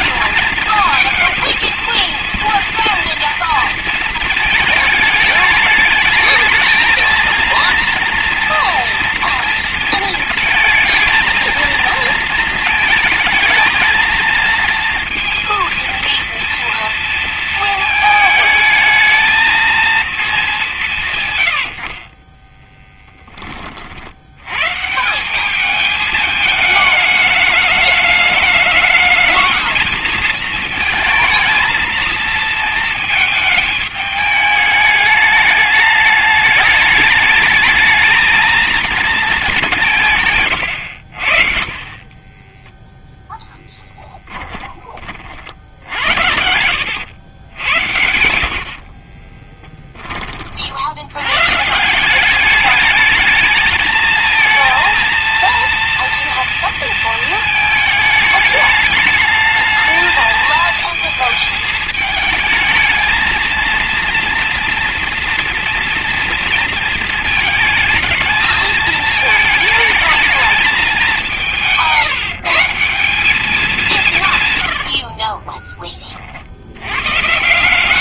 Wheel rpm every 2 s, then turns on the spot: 220, 230, 220, 220, 230, 220, 220, 230, 230, 220, 200, 20, 110, 220, 210, 220, 220, 210, 210, 220, 130, 20, 10, 80, 60, 50, 200, 220, 230, 210, 220, 220, 230, 230, 220, 210, 170, 130, 60.
22-24 42-44 46-50 74-76